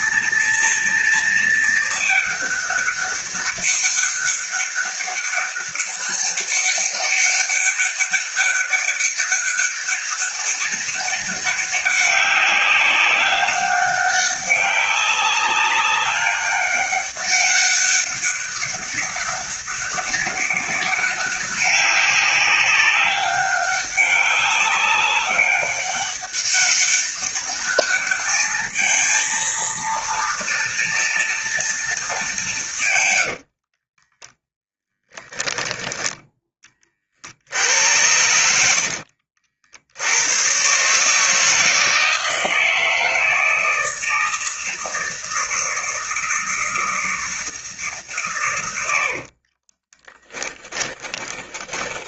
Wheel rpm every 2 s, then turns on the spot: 230, 210, 200, 200, 200, 200, 190, 200, 200, 200, 200, 200, 200, 200, 220, 230, 160, 10, 20, 80, 130, 160, 160, 170, 100, 20.
34-36 38-40 48-52